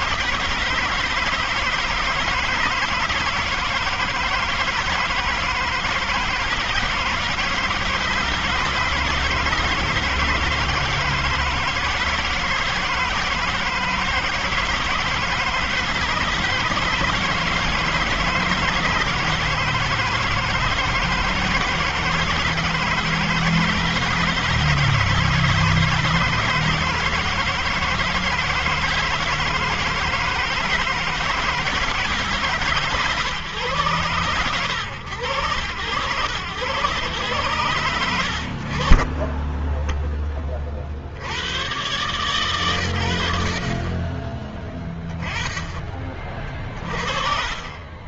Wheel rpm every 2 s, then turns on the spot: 160, 160, 160, 160, 160, 160, 160, 160, 160, 160, 160, 160, 170, 170, 160, 160, 160, 120, 110, 60, 20, 130, 20, 40.
46-48